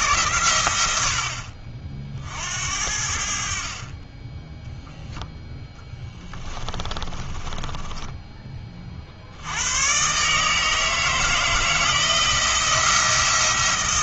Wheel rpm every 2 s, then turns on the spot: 100, 70, 0, 20, 40, 160, 170.
6-8